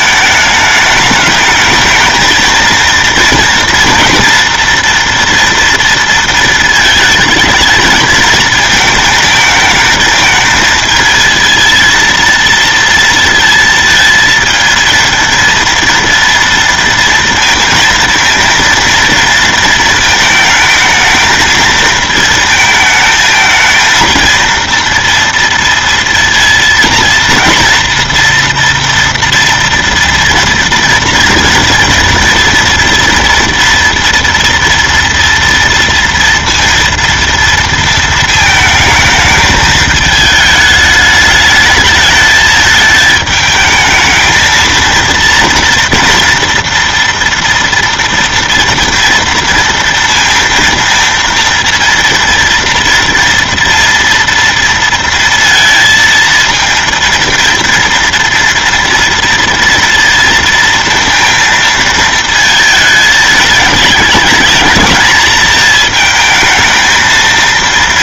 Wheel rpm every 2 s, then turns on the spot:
210, 220, 230, 220, 220, 220, 230, 220, 230, 230, 220, 220, 230, 230, 230, 230, 230, 230, 230, 220, 210, 220, 220, 230, 230, 230, 230, 230, 230, 230, 230, 220, 220, 220.
none